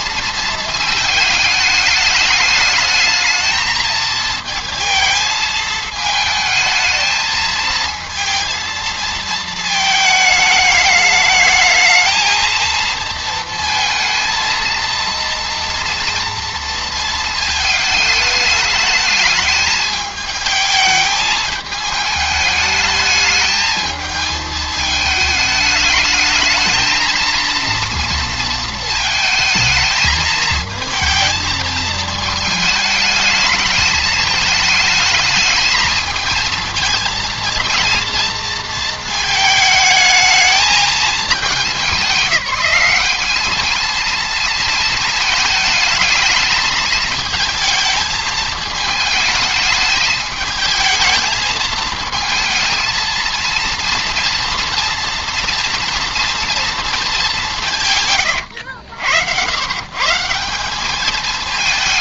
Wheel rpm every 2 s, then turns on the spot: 230, 220, 220, 220, 230, 210, 220, 230, 230, 210, 220, 210, 220, 220, 230, 220, 220, 220, 220, 230, 220, 190, 220, 220, 220, 220, 220, 240, 230, 90, 180.
58-60